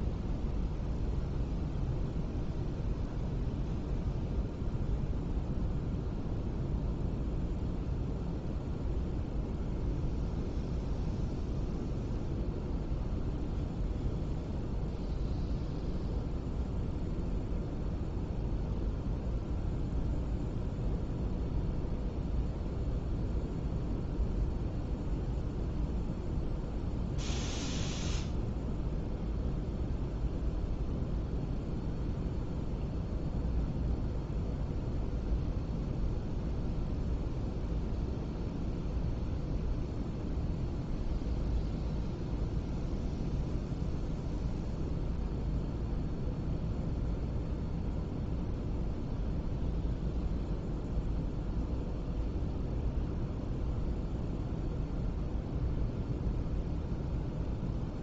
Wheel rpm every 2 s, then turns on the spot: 0, 0, 0, 0, 0, 0, 0, 0, 0, 0, 0, 0, 0, 0, 0, 0, 0, 0, 0, 0, 0, 0, 0, 0, 0, 0, 0, 0, 0.
none